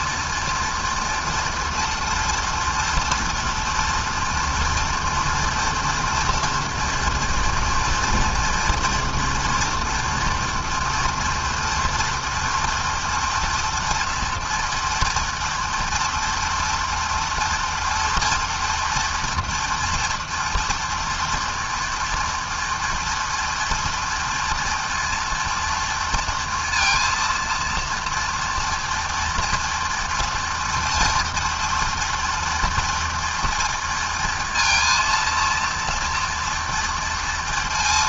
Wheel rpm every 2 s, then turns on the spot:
230, 230, 230, 230, 230, 230, 230, 240, 230, 230, 230, 230, 230, 230, 230, 230, 230, 230, 230.
none